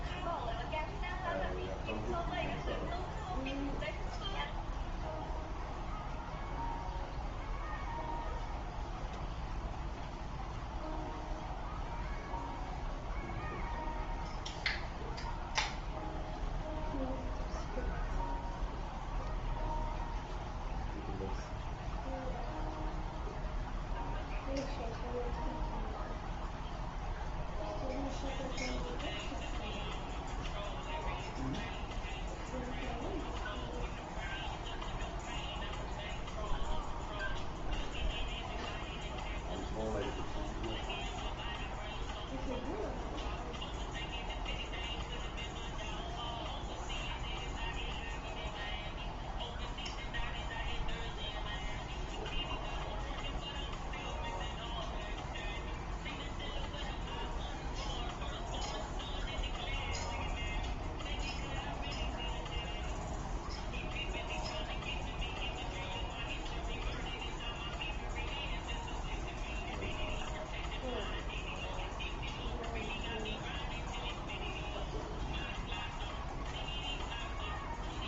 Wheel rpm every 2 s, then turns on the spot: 0, 0, 0, 0, 0, 0, 0, 0, 0, 0, 0, 0, 0, 0, 0, 0, 0, 0, 0, 0, 0, 0, 0, 0, 0, 0, 0, 0, 0, 0, 0, 0, 0, 0, 0, 0, 0, 0, 0.
none